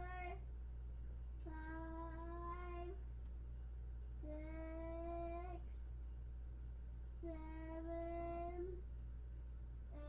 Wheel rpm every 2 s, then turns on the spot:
0, 0, 0, 0, 0.
none